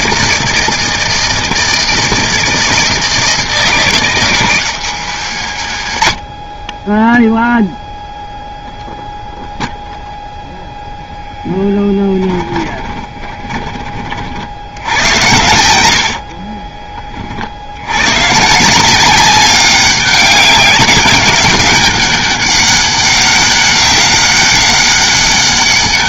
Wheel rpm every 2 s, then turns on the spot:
160, 160, 170, 50, 0, 0, 20, 60, 40, 150, 190, 200, 200.
12-14 16-18